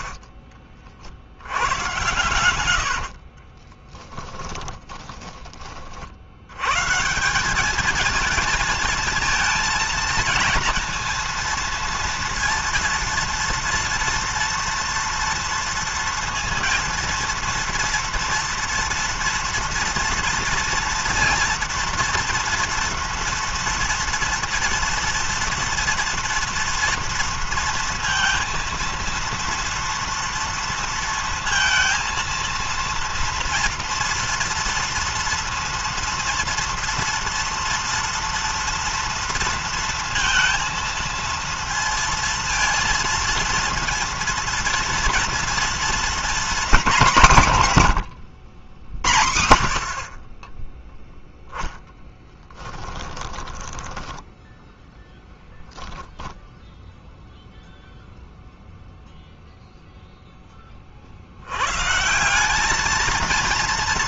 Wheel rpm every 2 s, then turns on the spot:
40, 120, 20, 90, 220, 230, 230, 230, 230, 230, 230, 230, 230, 230, 230, 230, 230, 230, 230, 230, 230, 230, 230, 240, 100, 40, 10, 0, 0, 0, 20, 200.
0-6 52-54